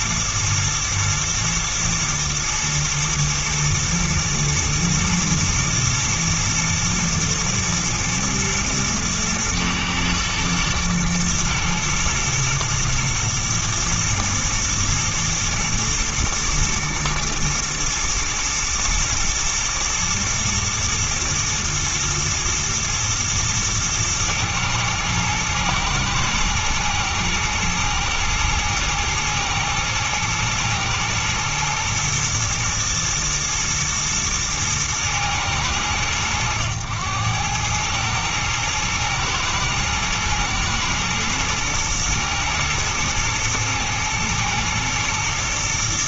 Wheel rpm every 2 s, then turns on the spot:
110, 120, 110, 110, 110, 110, 120, 120, 110, 110, 120, 110, 120, 120, 110, 110, 120, 110, 100, 110, 110, 110, 120.
none